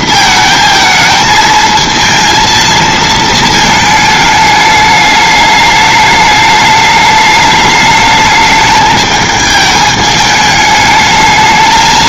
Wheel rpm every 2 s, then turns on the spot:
220, 220, 210, 210, 210, 210.
none